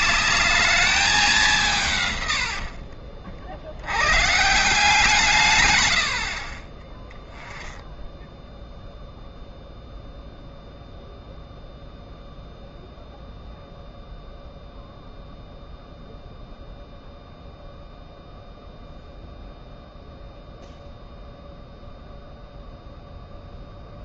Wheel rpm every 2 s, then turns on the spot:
210, 60, 160, 30, 0, 0, 0, 0, 0, 0, 0, 0.
2-4